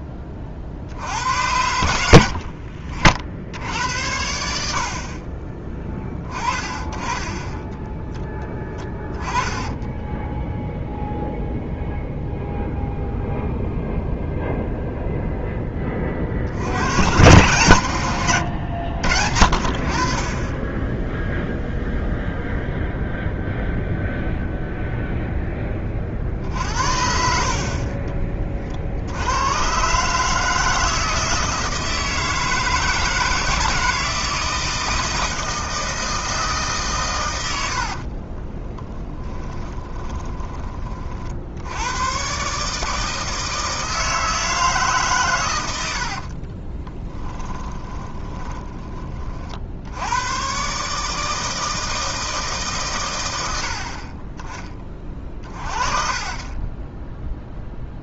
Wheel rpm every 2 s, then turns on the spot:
40, 50, 60, 20, 10, 0, 0, 0, 100, 90, 10, 0, 0, 60, 50, 160, 160, 160, 140, 20, 30, 150, 160, 30, 20, 130, 140, 30, 10.
2-4 38-40 46-48 56-58